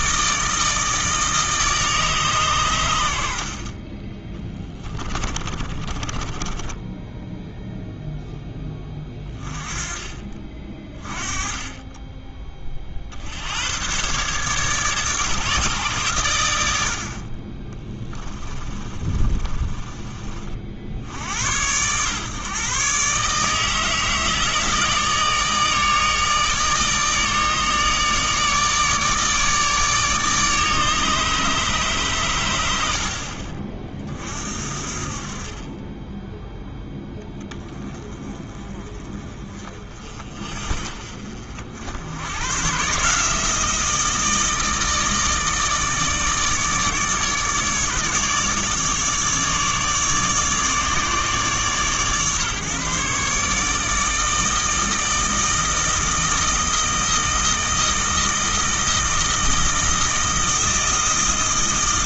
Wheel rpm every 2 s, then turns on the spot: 160, 110, 20, 10, 10, 30, 40, 150, 80, 30, 60, 130, 160, 150, 150, 150, 90, 50, 0, 30, 40, 130, 160, 150, 150, 150, 140, 160, 160, 160, 160.
4-8 18-20